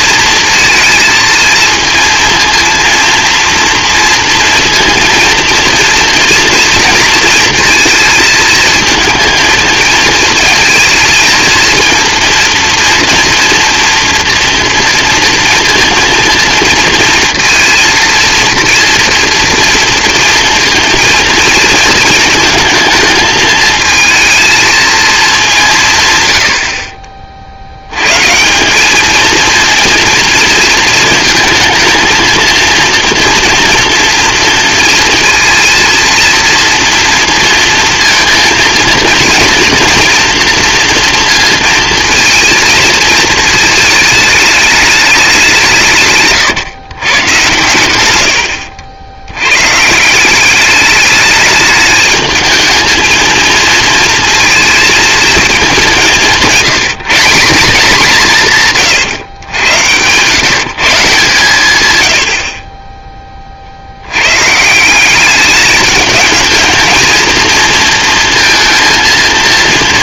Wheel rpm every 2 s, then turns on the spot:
220, 230, 230, 230, 220, 220, 240, 230, 230, 230, 230, 230, 230, 90, 170, 230, 230, 230, 230, 230, 230, 220, 220, 140, 90, 190, 210, 230, 190, 180, 140, 60, 120, 220, 230.
48-50